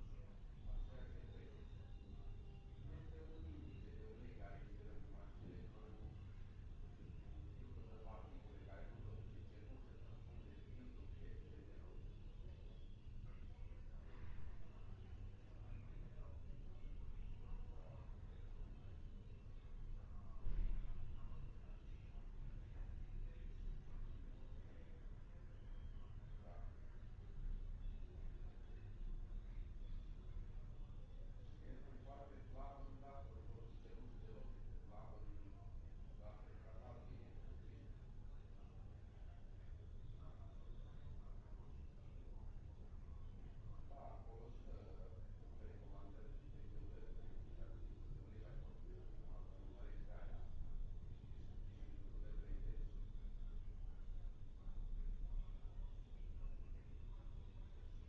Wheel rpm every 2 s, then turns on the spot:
0, 0, 0, 0, 0, 0, 0, 0, 0, 0, 0, 0, 0, 0, 0, 0, 0, 0, 0, 0, 0, 0, 0, 0, 0, 0, 0, 0, 0.
none